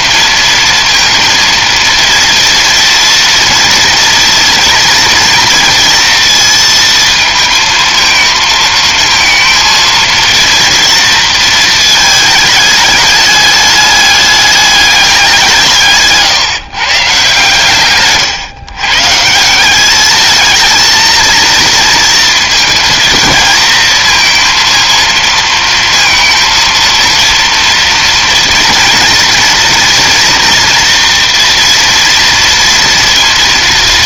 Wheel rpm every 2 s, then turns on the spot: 230, 230, 230, 230, 220, 230, 210, 210, 150, 130, 220, 220, 230, 230, 230, 230, 230.
none